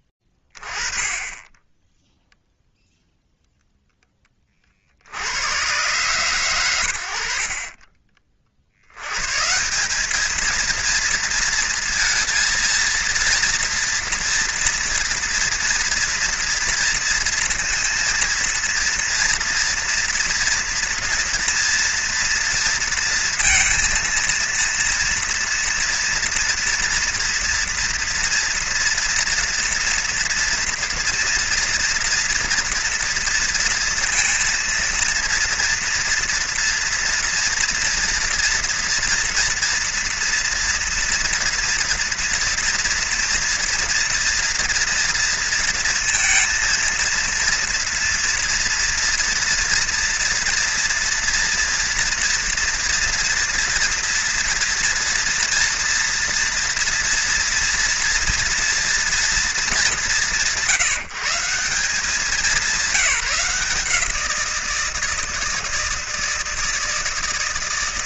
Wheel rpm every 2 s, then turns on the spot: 30, 0, 50, 110, 90, 230, 230, 230, 230, 230, 230, 230, 230, 230, 240, 230, 230, 230, 230, 240, 240, 230, 230, 230, 230, 230, 230, 230, 230, 230, 160, 180, 160, 160.
none